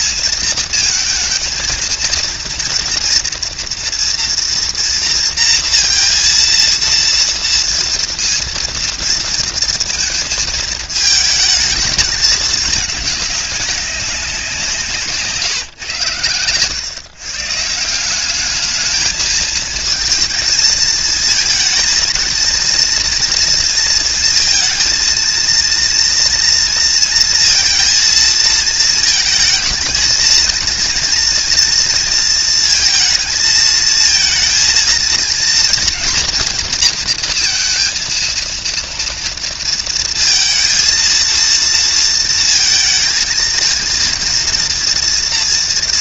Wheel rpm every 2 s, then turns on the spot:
230, 230, 230, 230, 230, 230, 210, 170, 120, 210, 220, 230, 230, 230, 220, 230, 230, 230, 230, 230, 230, 230, 230.
none